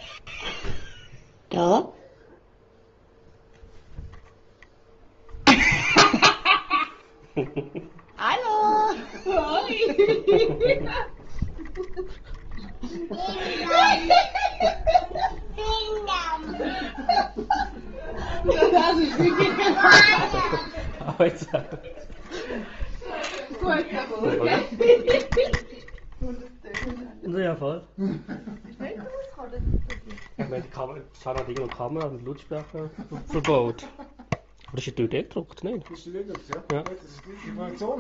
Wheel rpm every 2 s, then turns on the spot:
0, 0, 0, 0, 0, 0, 0, 0, 0, 0, 0, 0, 0, 0, 0, 0, 0, 0, 0.
none